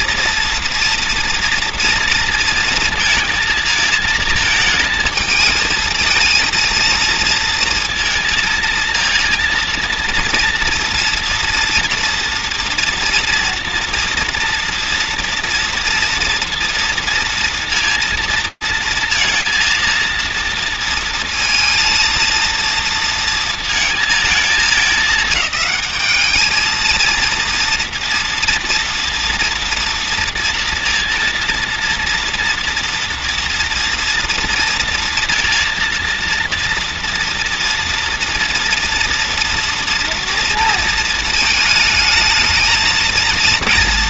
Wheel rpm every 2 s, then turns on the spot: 230, 230, 220, 230, 230, 230, 230, 240, 230, 230, 230, 230, 220, 220, 230, 230, 230, 230, 230, 230, 230, 220.
none